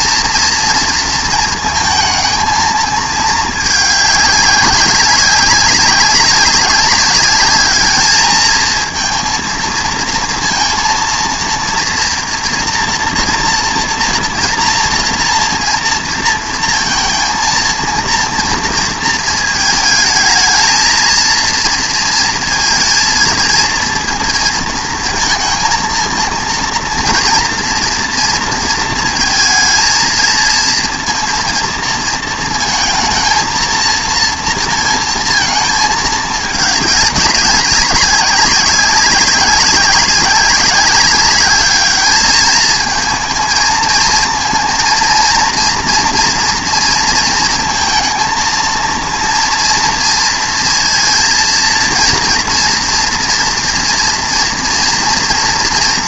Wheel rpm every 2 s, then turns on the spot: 230, 220, 190, 200, 220, 230, 230, 230, 230, 230, 230, 230, 230, 230, 230, 230, 220, 230, 210, 190, 190, 220, 230, 230, 230, 230, 230, 240.
none